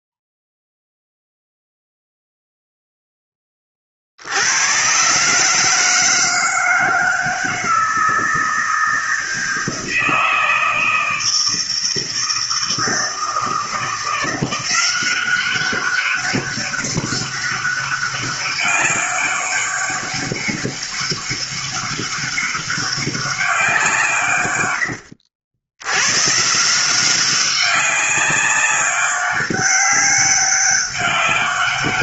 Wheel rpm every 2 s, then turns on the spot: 0, 0, 90, 160, 160, 160, 160, 170, 200, 200, 200, 200, 130, 150, 190, 200.
none